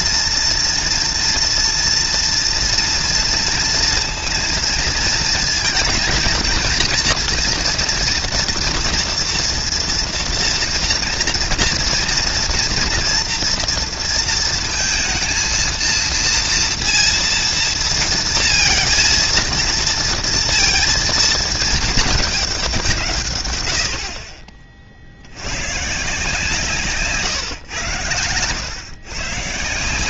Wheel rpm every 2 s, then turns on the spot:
230, 230, 230, 230, 230, 230, 230, 230, 230, 230, 230, 150, 60, 140, 130.
none